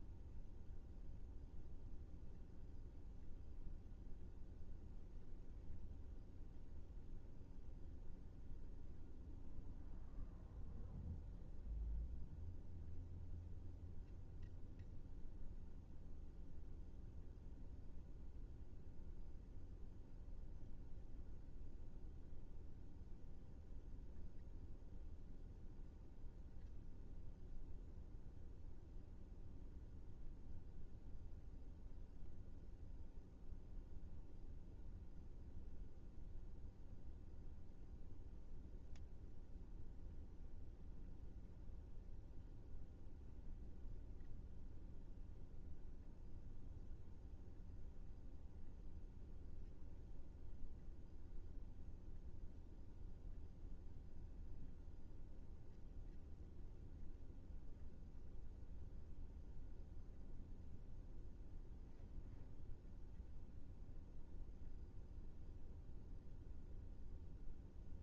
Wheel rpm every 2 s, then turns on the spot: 0, 0, 0, 0, 0, 0, 0, 0, 0, 0, 0, 0, 0, 0, 0, 0, 0, 0, 0, 0, 0, 0, 0, 0, 0, 0, 0, 0, 0, 0, 0, 0, 0, 0.
none